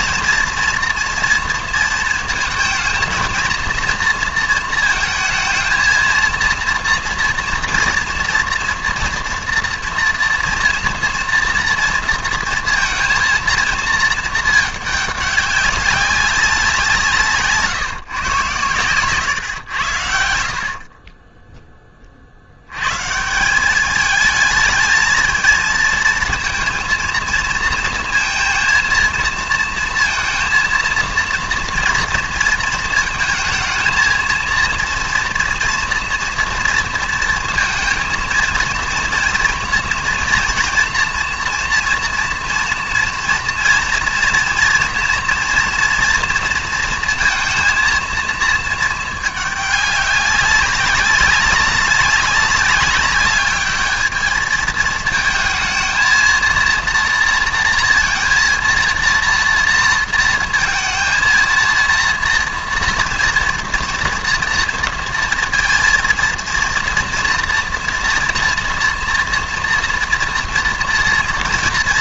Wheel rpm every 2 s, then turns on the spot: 230, 230, 230, 230, 240, 240, 230, 220, 190, 120, 70, 90, 220, 230, 230, 230, 220, 230, 230, 230, 230, 230, 230, 230, 230, 190, 190, 220, 230, 230, 230, 230, 230, 230, 240, 230.
none